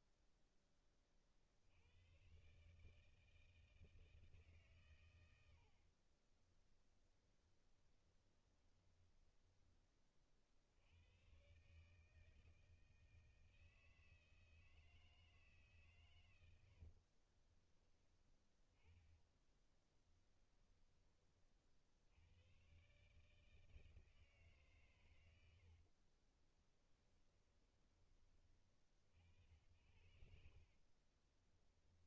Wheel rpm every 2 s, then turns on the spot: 10, 140, 140, 20, 10, 70, 160, 160, 80, 20, 10, 110, 140, 20, 40, 50.
6-10 16-20 26-28 30-32